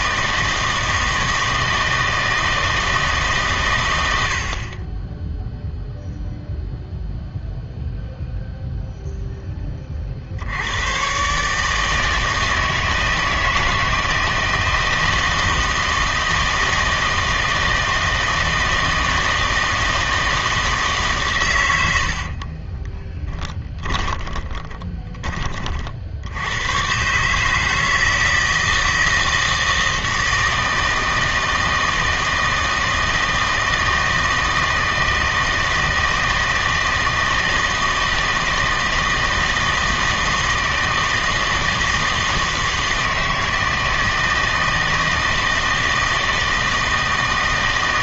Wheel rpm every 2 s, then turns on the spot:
160, 160, 40, 0, 0, 100, 160, 160, 160, 160, 160, 20, 20, 110, 160, 160, 160, 160, 160, 160, 160, 160, 160, 160.
22-26